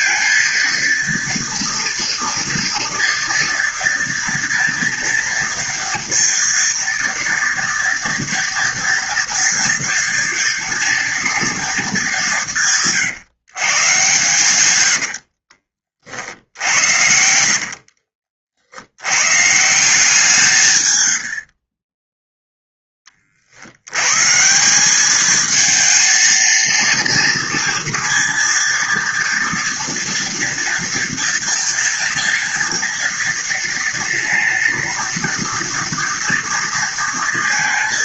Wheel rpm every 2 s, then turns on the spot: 230, 230, 230, 230, 230, 230, 140, 80, 70, 90, 100, 20, 200, 230, 230, 230, 230, 230, 230.
14-18 20-22